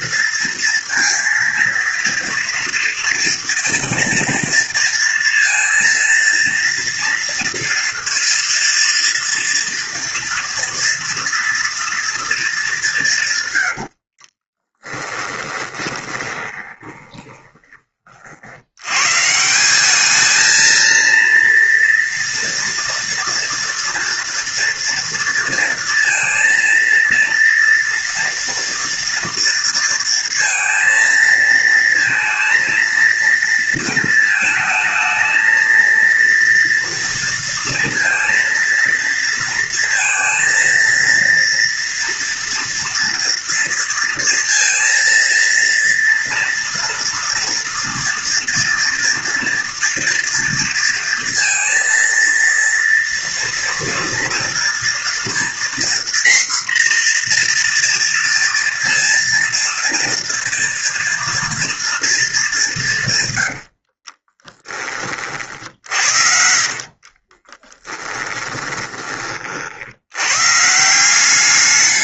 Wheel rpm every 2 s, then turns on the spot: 230, 230, 230, 230, 230, 230, 200, 20, 20, 90, 220, 230, 230, 230, 230, 230, 230, 220, 230, 230, 230, 230, 230, 230, 230, 230, 230, 230, 240, 230, 230, 170, 20, 50, 20, 150.
14-18 66-70